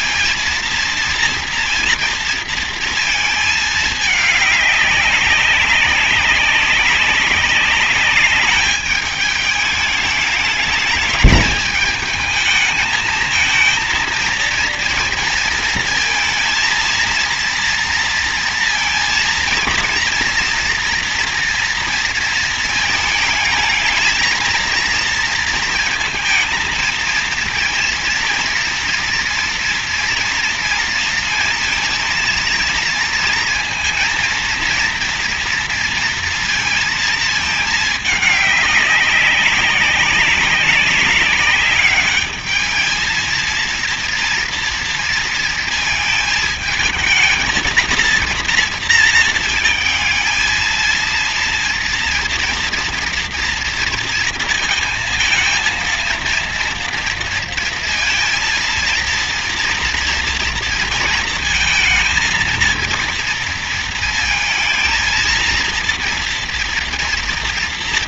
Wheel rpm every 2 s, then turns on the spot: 230, 230, 200, 190, 210, 210, 220, 230, 230, 230, 230, 230, 230, 220, 230, 230, 230, 230, 230, 200, 190, 220, 230, 220, 230, 230, 230, 230, 230, 230, 230, 230, 220, 230.
none